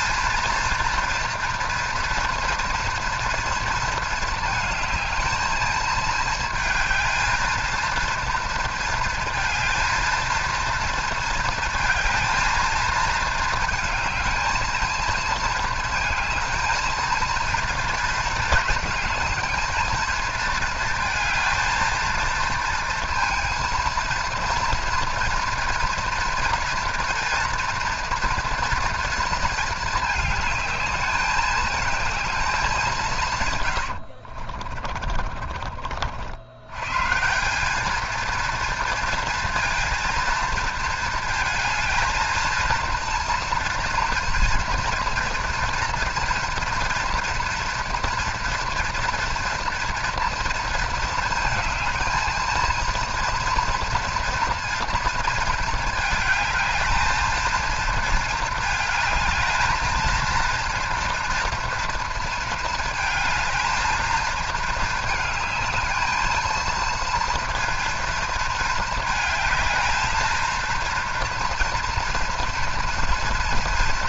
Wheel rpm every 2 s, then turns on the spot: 230, 230, 220, 230, 230, 230, 220, 220, 220, 230, 230, 230, 230, 230, 230, 210, 210, 50, 80, 230, 230, 230, 240, 230, 230, 230, 230, 230, 220, 220, 230, 220, 220, 230, 220, 230, 240.
34-36